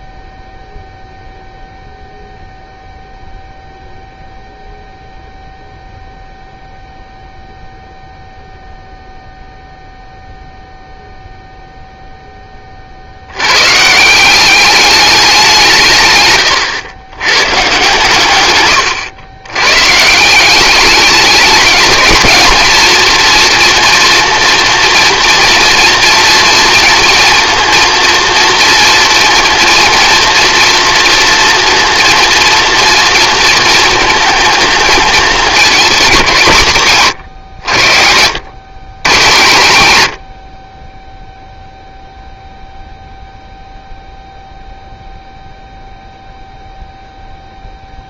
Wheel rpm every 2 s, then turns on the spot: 0, 0, 0, 0, 0, 0, 30, 200, 100, 110, 190, 230, 230, 230, 230, 230, 230, 220, 150, 130, 40, 0, 0, 0.
none